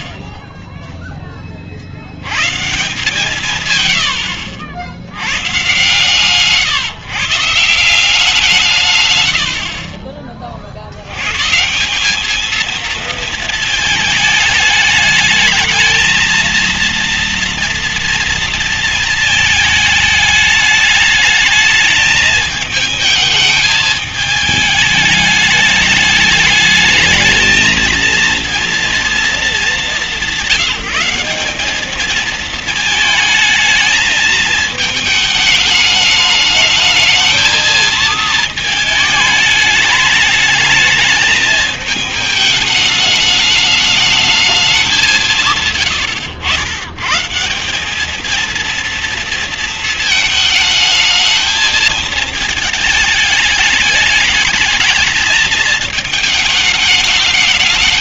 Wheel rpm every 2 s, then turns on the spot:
70, 130, 80, 140, 170, 50, 220, 220, 230, 230, 210, 220, 210, 210, 230, 190, 220, 220, 210, 220, 210, 210, 210, 120, 220, 220, 220, 210, 210.
none